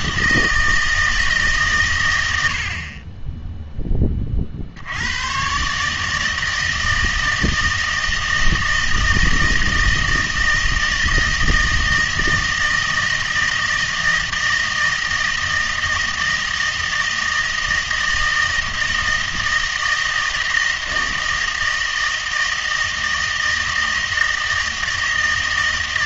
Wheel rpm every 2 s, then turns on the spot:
160, 60, 60, 160, 160, 160, 160, 160, 160, 160, 160, 160, 160.
none